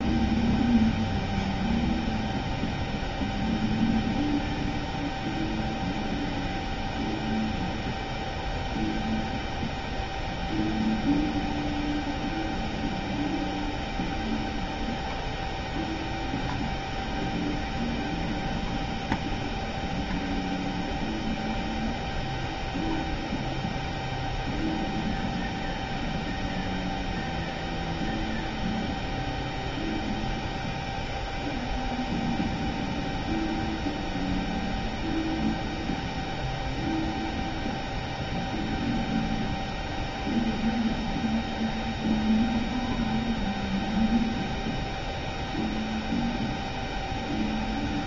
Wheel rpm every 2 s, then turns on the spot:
0, 0, 0, 0, 0, 0, 0, 0, 0, 0, 0, 0, 0, 0, 0, 0, 0, 0, 0, 0, 0, 0, 0, 0.
none